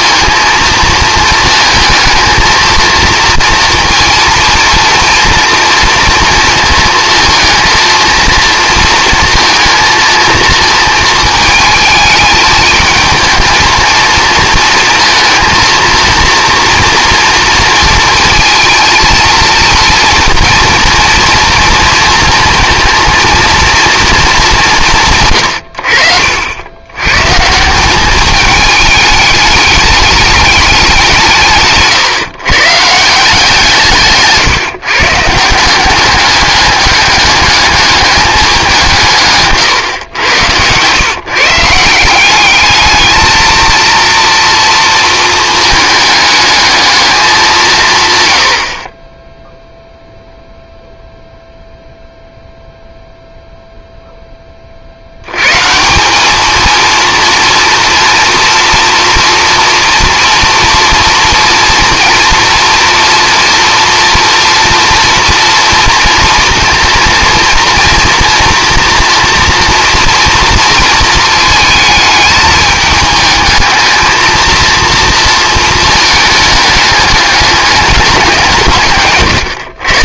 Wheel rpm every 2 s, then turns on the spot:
220, 230, 230, 230, 230, 230, 220, 220, 230, 220, 230, 230, 180, 110, 210, 190, 150, 140, 200, 170, 120, 210, 230, 220, 50, 0, 0, 50, 220, 230, 230, 230, 230, 230, 240, 230, 210, 230, 210, 140.
none